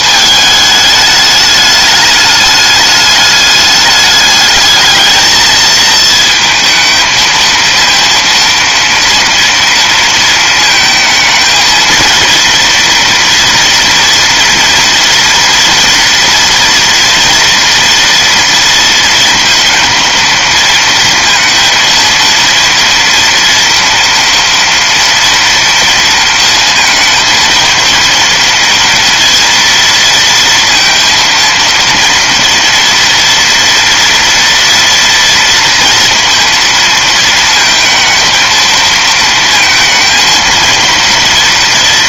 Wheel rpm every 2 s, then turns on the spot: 220, 210, 210, 220, 230, 220, 230, 240, 240, 230, 230, 230, 230, 230, 230, 230, 240, 230, 230, 220, 230.
none